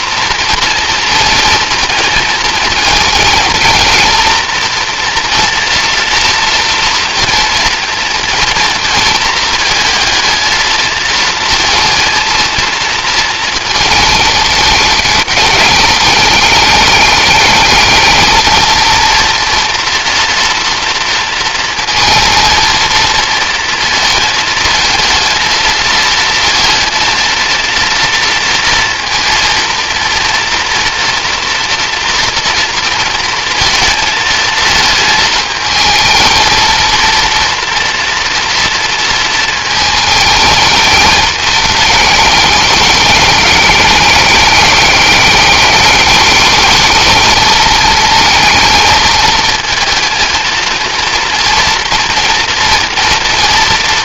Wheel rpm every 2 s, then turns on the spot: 230, 230, 230, 230, 220, 230, 230, 210, 210, 230, 230, 230, 220, 230, 230, 230, 230, 220, 230, 230, 210, 210, 210, 220, 230, 230, 230.
none